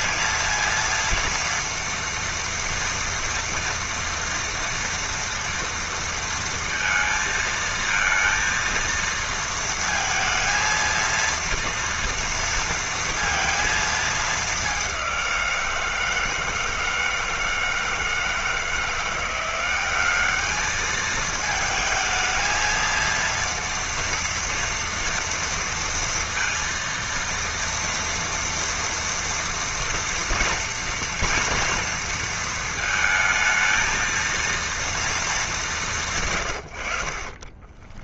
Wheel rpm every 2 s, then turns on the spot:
230, 230, 230, 230, 230, 230, 230, 210, 160, 160, 210, 220, 230, 230, 230, 240, 230, 230, 110.
36-38